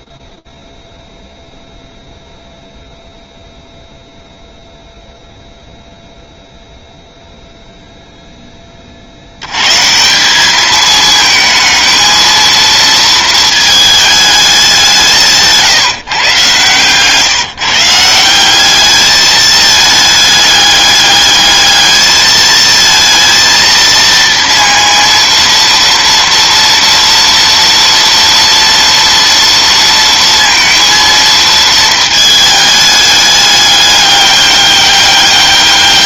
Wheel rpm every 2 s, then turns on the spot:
0, 0, 0, 0, 70, 220, 220, 170, 160, 210, 210, 230, 230, 230, 230, 230, 210, 200.
14-16